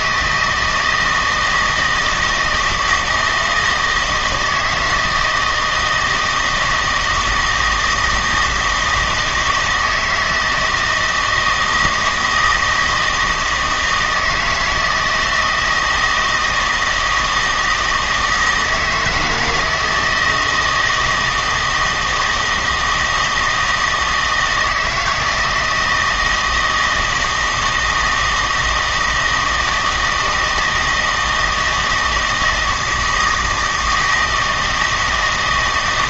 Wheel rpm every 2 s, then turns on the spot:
160, 160, 160, 160, 160, 160, 170, 160, 160, 160, 160, 160, 160, 160, 160, 160, 160, 160.
none